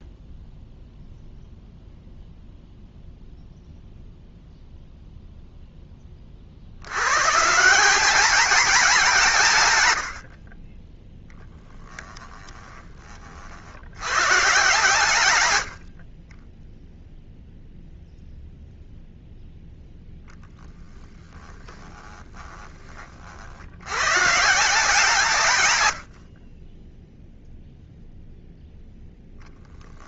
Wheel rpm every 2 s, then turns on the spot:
0, 0, 0, 110, 200, 20, 30, 130, 0, 0, 10, 20, 160, 10, 0.
10-12 20-22